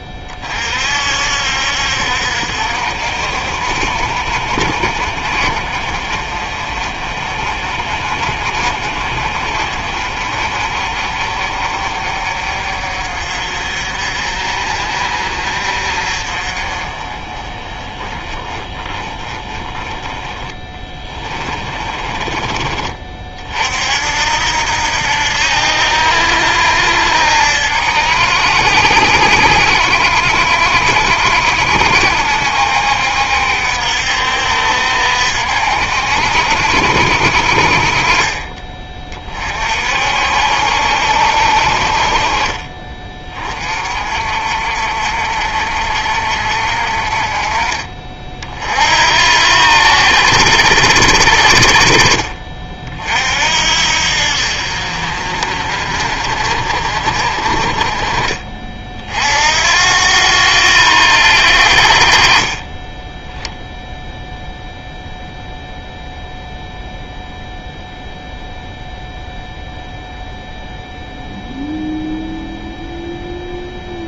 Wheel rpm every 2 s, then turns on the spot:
50, 50, 40, 40, 40, 50, 50, 50, 30, 20, 20, 30, 80, 70, 70, 70, 70, 60, 50, 30, 60, 30, 50, 50, 60, 70, 50, 50, 50, 40, 90, 10, 0, 0, 0, 0, 0.
20-22